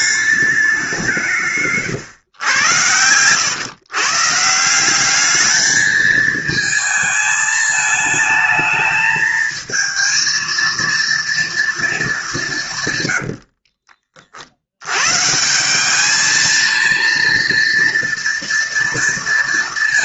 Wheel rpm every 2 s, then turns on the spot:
180, 110, 190, 220, 220, 230, 110, 120, 230, 230.
none